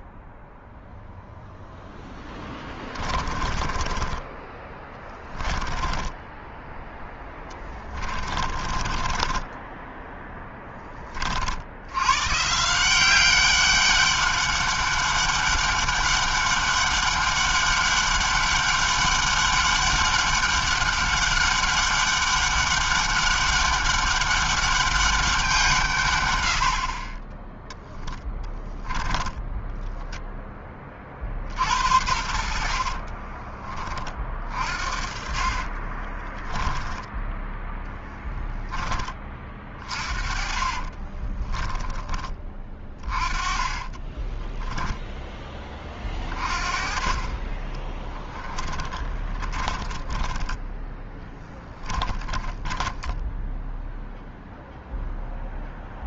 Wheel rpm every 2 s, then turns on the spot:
0, 30, 20, 10, 20, 30, 190, 200, 200, 200, 200, 200, 200, 30, 10, 40, 40, 40, 10, 20, 20, 20, 10, 30, 20, 10, 10, 0.
2-10 28-30 32-38 40-44 48-52